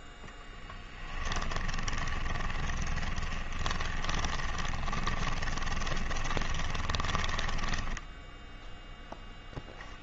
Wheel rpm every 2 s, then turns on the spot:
10, 20, 20, 20, 0.
0-8